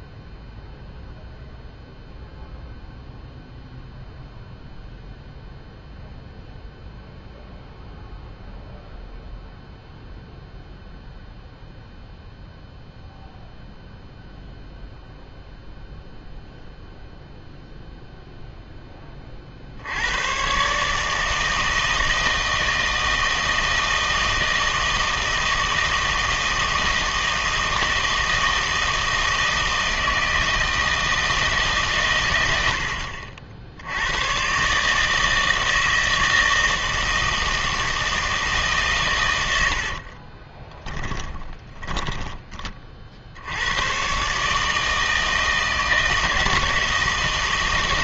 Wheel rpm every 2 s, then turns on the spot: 0, 0, 0, 0, 0, 0, 0, 0, 0, 10, 130, 160, 160, 160, 160, 160, 80, 130, 160, 150, 20, 30, 150, 160.
40-42